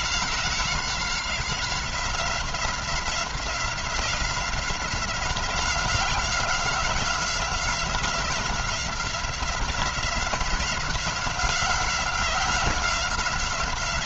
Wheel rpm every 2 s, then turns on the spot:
180, 180, 180, 190, 190, 190, 180.
none